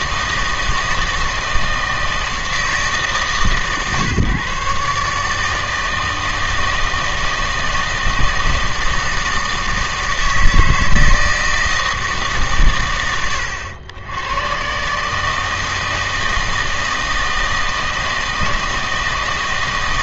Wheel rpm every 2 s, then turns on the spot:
160, 160, 140, 160, 160, 160, 110, 130, 160, 160.
none